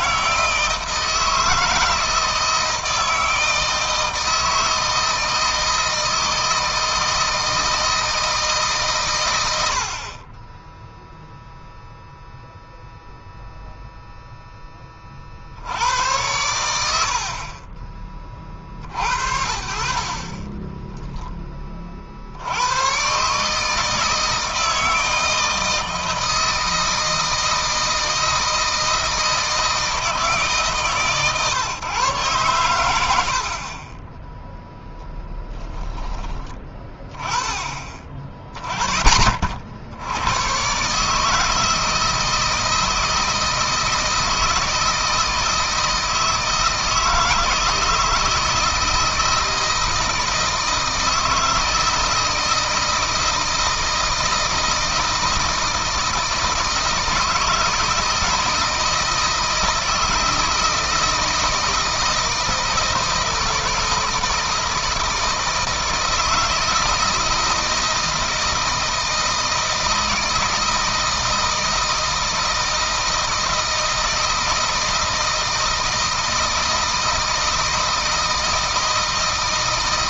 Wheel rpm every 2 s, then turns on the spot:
160, 160, 160, 160, 140, 10, 0, 10, 90, 50, 20, 90, 160, 160, 160, 150, 110, 0, 20, 20, 130, 160, 160, 160, 170, 160, 160, 160, 160, 160, 160, 160, 160, 160, 160, 160, 160, 160, 160, 160.
20-22